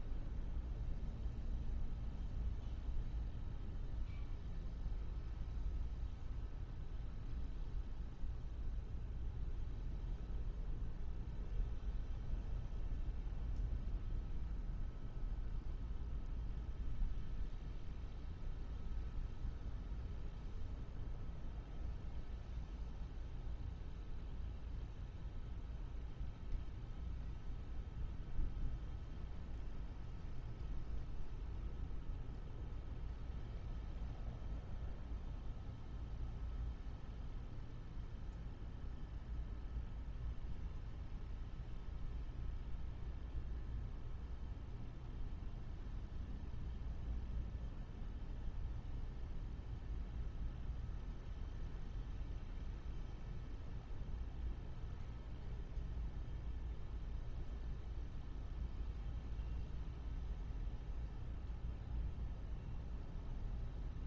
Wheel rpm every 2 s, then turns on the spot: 0, 0, 0, 0, 0, 0, 0, 0, 0, 0, 0, 0, 0, 0, 0, 0, 0, 0, 0, 0, 0, 0, 0, 0, 0, 0, 0, 0, 0, 0, 0, 0.
none